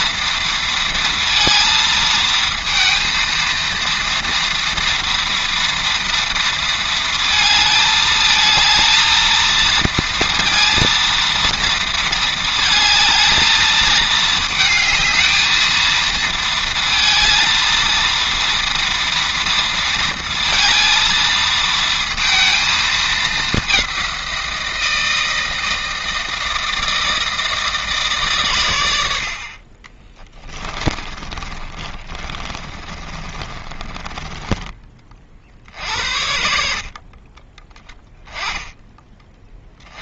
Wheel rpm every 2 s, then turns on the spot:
230, 230, 230, 230, 220, 230, 220, 220, 220, 230, 230, 230, 180, 160, 130, 30, 30, 20, 70, 10.
30-36